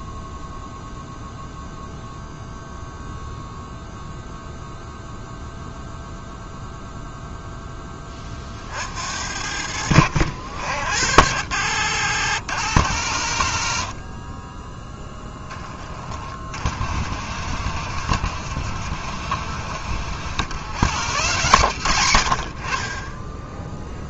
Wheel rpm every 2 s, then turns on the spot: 0, 0, 0, 0, 60, 80, 110, 10, 40, 60, 150, 50.
none